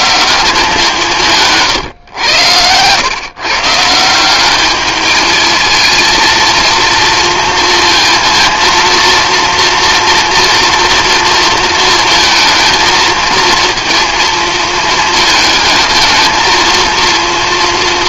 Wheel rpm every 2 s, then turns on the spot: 170, 110, 210, 230, 230, 230, 220, 220, 230.
none